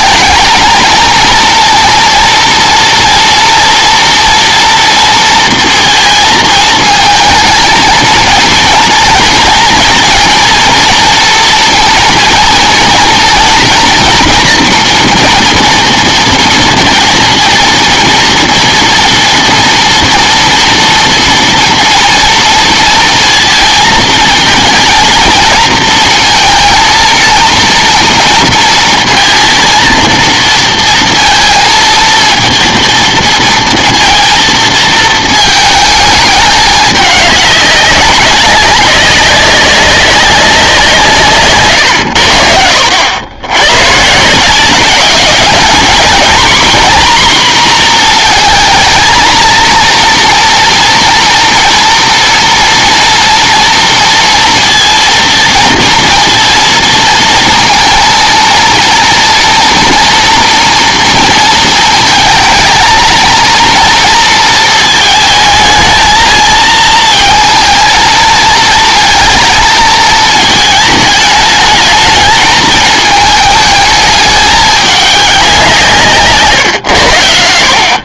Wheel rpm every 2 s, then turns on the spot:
220, 230, 230, 220, 230, 230, 230, 240, 230, 230, 230, 230, 230, 230, 230, 230, 230, 230, 210, 190, 180, 80, 190, 250, 230, 230, 230, 230, 230, 230, 230, 220, 230, 230, 220, 220, 220, 210, 130.
none